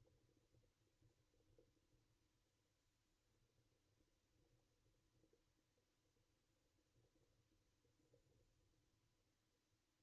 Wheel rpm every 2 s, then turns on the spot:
0, 0, 0, 0, 0.
none